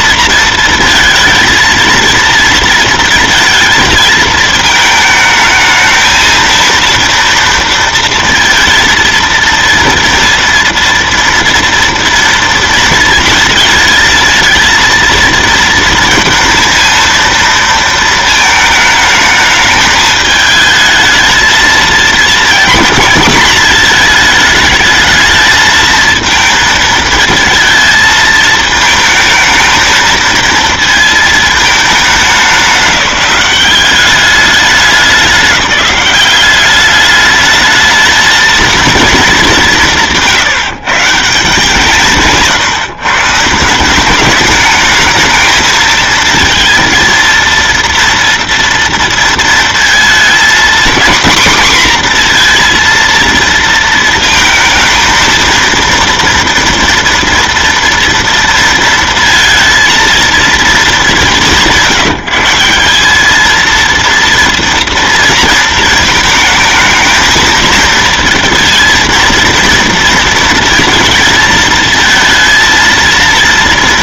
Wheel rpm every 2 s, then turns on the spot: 230, 230, 220, 230, 230, 230, 230, 230, 230, 220, 220, 230, 220, 220, 220, 230, 200, 200, 200, 230, 160, 150, 210, 230, 230, 240, 240, 220, 240, 230, 230, 170, 230, 220, 230, 230, 230.
none